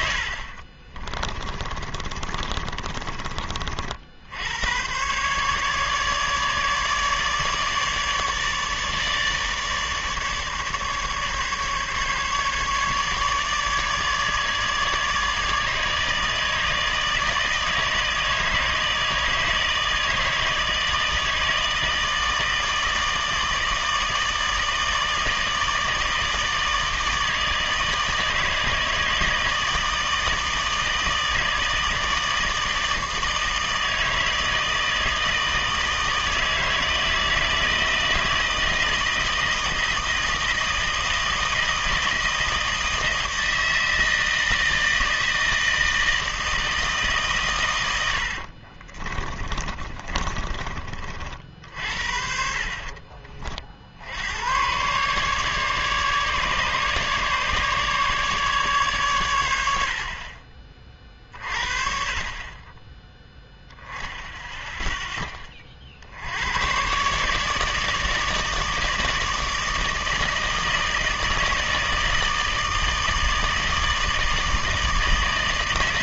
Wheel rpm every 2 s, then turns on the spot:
40, 30, 110, 150, 150, 150, 150, 150, 160, 160, 160, 160, 160, 160, 160, 160, 160, 160, 160, 160, 160, 160, 160, 160, 50, 30, 50, 110, 150, 140, 30, 20, 0, 120, 160, 160, 160, 160.
0-4 48-52